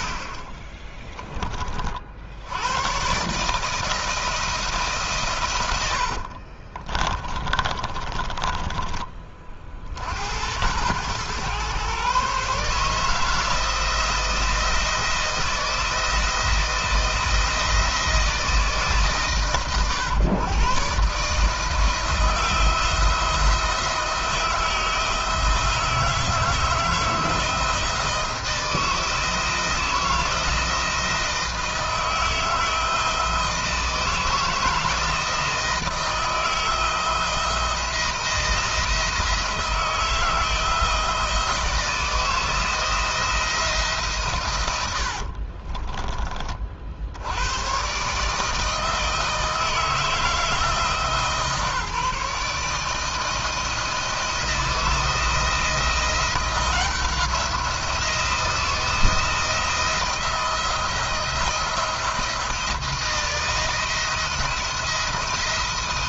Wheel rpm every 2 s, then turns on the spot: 40, 110, 150, 30, 20, 100, 150, 160, 160, 140, 140, 160, 160, 160, 160, 160, 160, 160, 160, 160, 160, 170, 90, 60, 160, 160, 150, 170, 170, 170, 170, 170, 170.
0-2 6-8 44-46